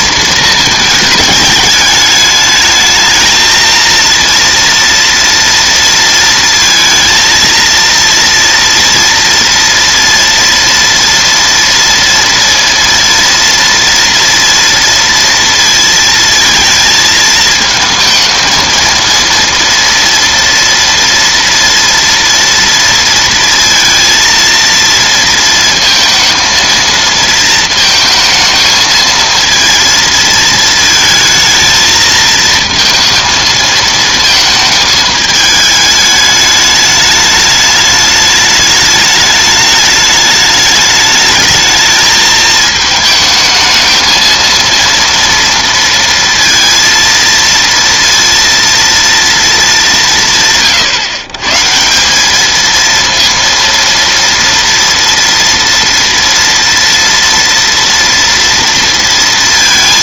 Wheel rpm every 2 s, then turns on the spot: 210, 220, 230, 230, 230, 230, 230, 230, 220, 220, 230, 230, 230, 230, 220, 220, 230, 220, 210, 210, 210, 220, 230, 230, 230, 140, 230, 230, 230, 230.
none